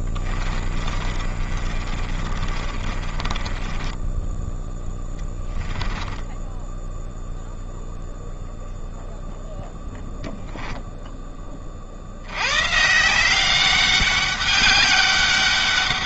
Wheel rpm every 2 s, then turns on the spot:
20, 30, 10, 10, 0, 0, 90, 200.
0-8